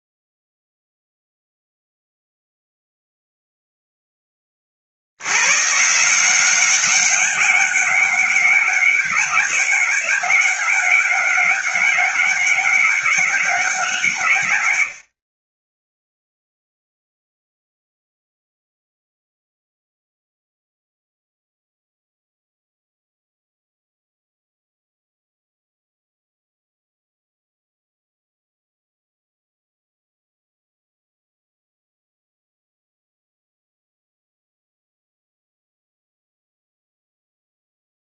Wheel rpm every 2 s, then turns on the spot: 0, 0, 80, 190, 200, 190, 190, 60, 0, 0, 0, 0, 0, 0, 0, 0, 0, 0, 0.
none